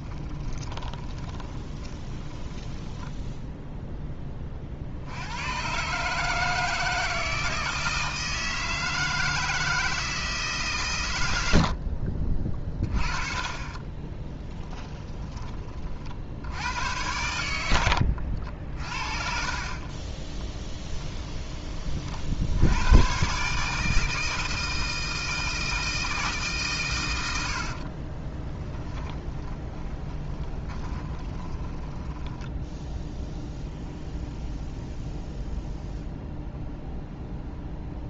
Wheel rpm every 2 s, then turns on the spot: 20, 20, 50, 160, 160, 140, 30, 10, 80, 60, 10, 90, 160, 130, 20, 20, 0, 0, 0.
0-4 14-16 20-22 28-32